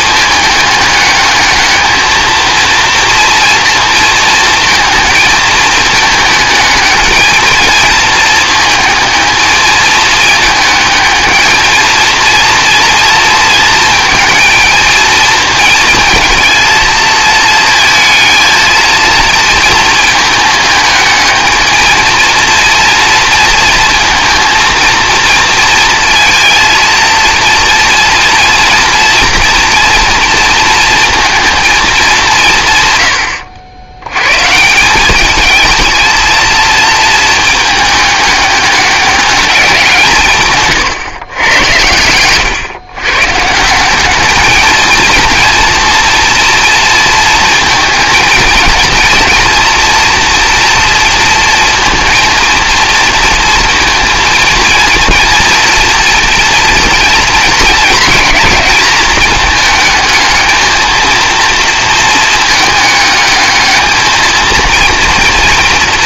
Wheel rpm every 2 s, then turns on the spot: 210, 230, 230, 220, 220, 220, 230, 230, 230, 230, 220, 230, 230, 230, 230, 230, 130, 180, 220, 200, 130, 120, 220, 230, 230, 230, 230, 230, 230, 210, 220, 220, 230.
none